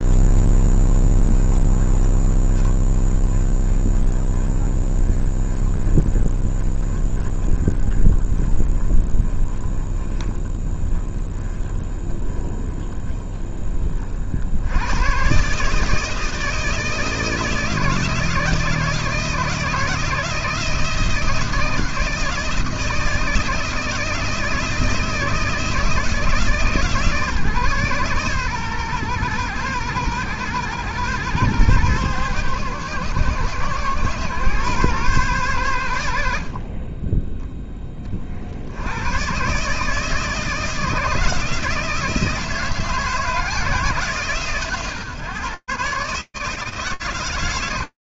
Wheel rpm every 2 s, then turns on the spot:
20, 20, 30, 20, 20, 20, 20, 100, 160, 160, 160, 160, 160, 150, 130, 120, 120, 130, 40, 60, 160, 160, 140, 150.
none